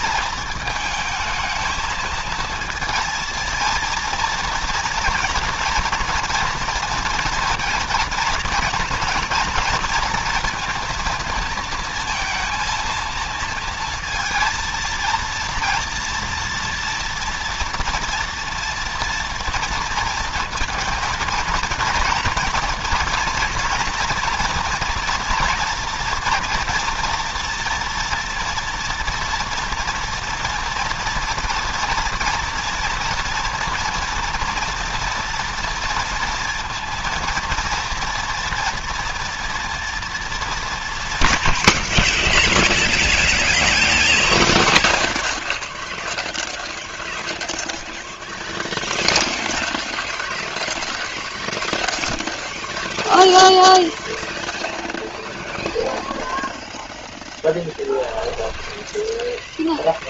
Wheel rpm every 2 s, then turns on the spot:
220, 220, 230, 230, 240, 230, 230, 230, 230, 230, 230, 240, 240, 230, 230, 230, 230, 230, 230, 230, 190, 10, 70, 0, 0, 0, 0, 0, 0, 10.
42-44 58-60